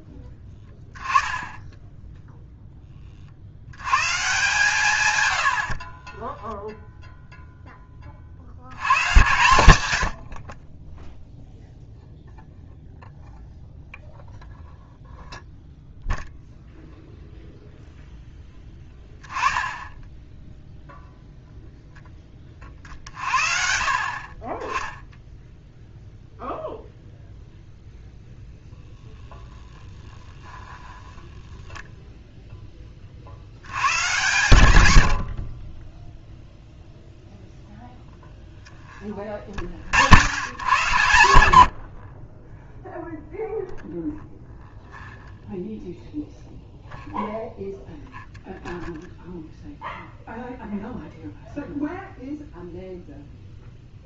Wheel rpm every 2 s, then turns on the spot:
10, 20, 150, 0, 90, 30, 0, 0, 0, 10, 0, 40, 10, 0, 0, 10, 10, 100, 0, 0, 120, 10, 0, 0, 0, 0, 0.
30-32